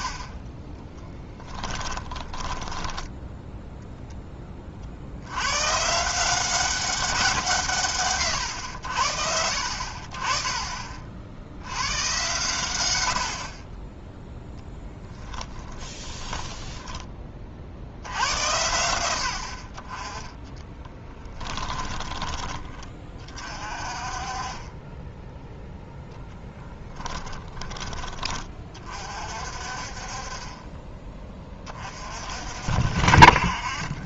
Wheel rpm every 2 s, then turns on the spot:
30, 10, 40, 190, 80, 40, 100, 20, 10, 120, 10, 30, 20, 10, 30, 20, 50.
2-4 14-16 20-22 26-28